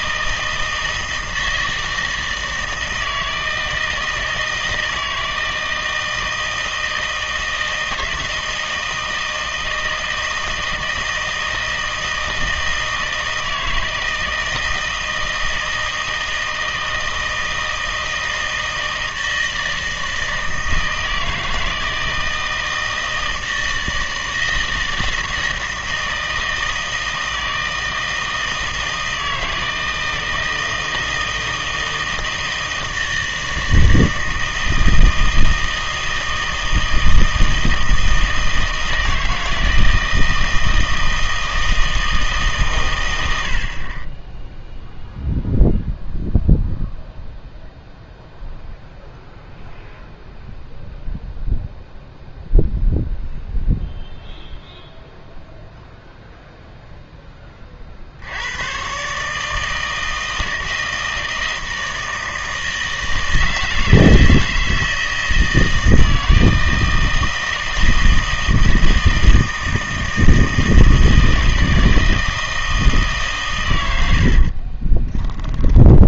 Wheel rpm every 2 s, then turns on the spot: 160, 160, 160, 160, 160, 160, 160, 160, 160, 160, 160, 160, 160, 160, 160, 160, 160, 160, 160, 160, 160, 140, 0, 0, 0, 0, 0, 0, 0, 110, 160, 160, 160, 160, 160, 160, 160, 40.
74-76